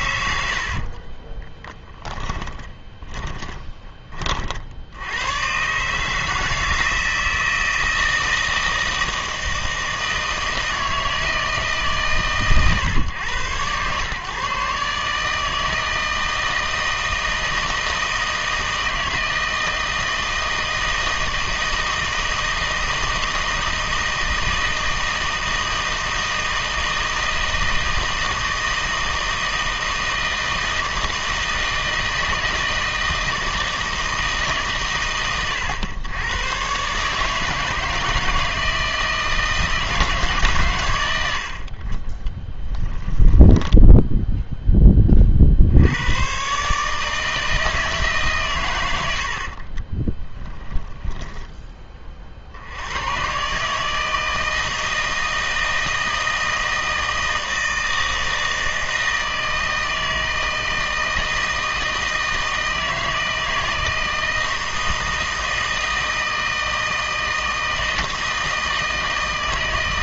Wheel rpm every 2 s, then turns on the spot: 60, 20, 60, 160, 160, 160, 130, 140, 160, 160, 160, 160, 160, 160, 160, 160, 160, 130, 120, 160, 130, 10, 10, 140, 110, 10, 70, 160, 160, 160, 160, 160, 160, 160, 160.
0-4 42-44 50-52